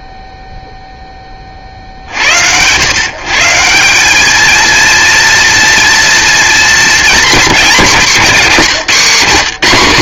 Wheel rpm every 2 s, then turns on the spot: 0, 110, 230, 220, 170.
none